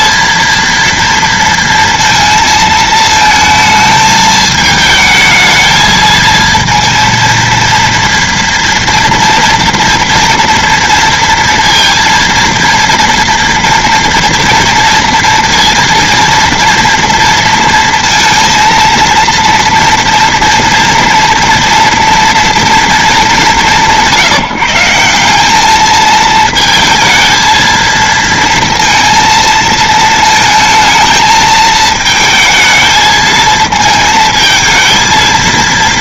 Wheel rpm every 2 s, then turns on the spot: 230, 220, 220, 230, 230, 230, 230, 230, 230, 230, 230, 220, 180, 220, 230, 220, 220, 230.
none